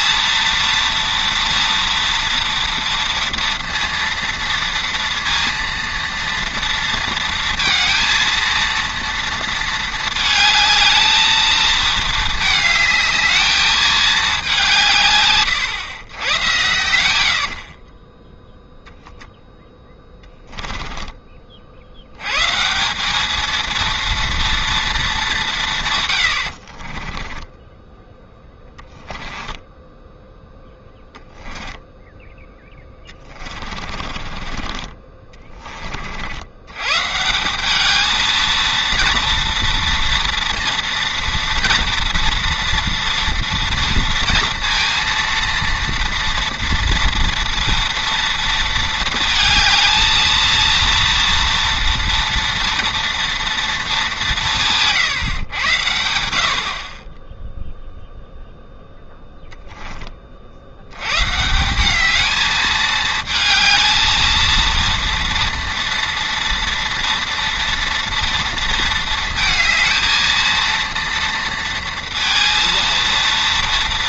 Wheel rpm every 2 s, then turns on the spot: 230, 230, 230, 230, 230, 220, 220, 180, 100, 0, 20, 160, 230, 50, 10, 10, 10, 30, 110, 230, 230, 230, 230, 230, 230, 230, 230, 160, 50, 0, 70, 220, 230, 230, 230, 230, 230.
20-22 26-34